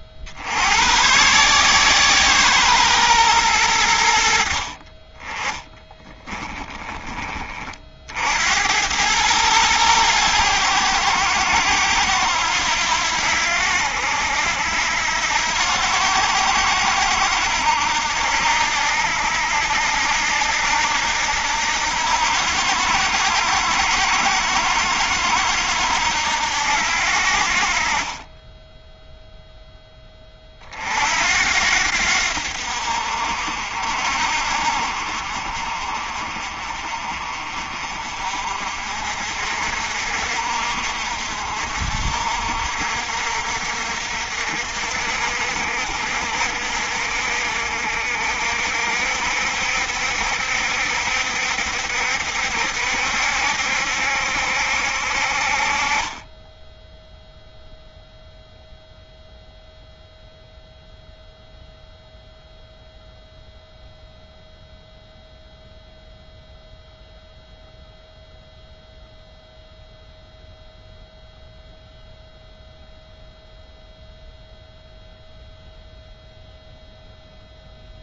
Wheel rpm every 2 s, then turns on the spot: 80, 120, 40, 20, 90, 90, 80, 80, 80, 80, 80, 80, 70, 70, 10, 50, 60, 50, 40, 50, 50, 60, 60, 60, 60, 70, 70, 60, 10, 0, 0, 0, 0, 0, 0, 0, 0, 0, 0.
none